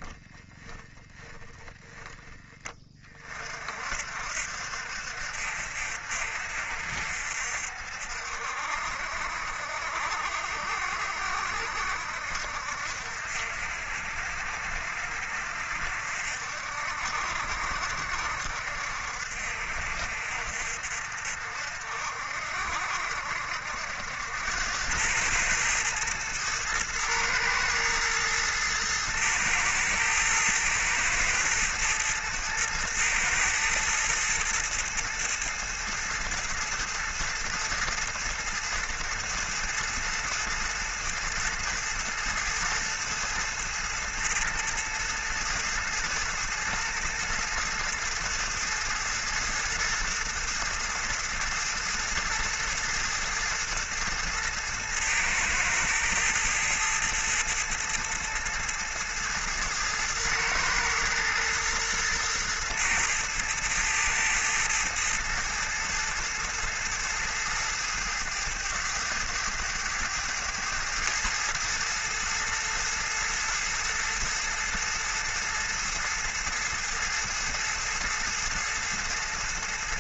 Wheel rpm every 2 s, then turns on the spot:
10, 30, 60, 60, 60, 60, 60, 60, 60, 60, 60, 70, 90, 110, 110, 110, 110, 110, 110, 110, 110, 110, 110, 110, 110, 110, 110, 110, 110, 110, 110, 110, 110, 110, 100, 110, 110, 110, 110, 110.
0-2